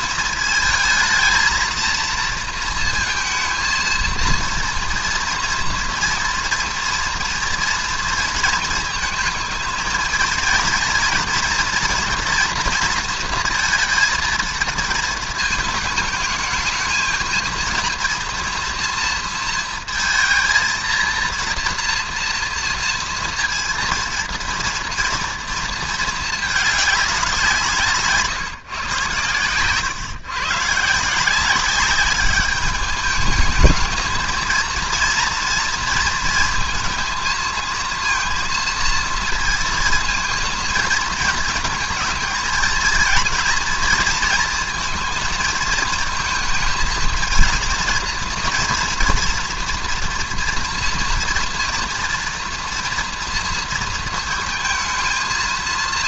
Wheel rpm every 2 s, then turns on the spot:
230, 230, 230, 230, 220, 230, 240, 230, 220, 230, 230, 230, 230, 220, 150, 130, 200, 230, 230, 230, 230, 220, 230, 220, 230, 230, 230, 230.
none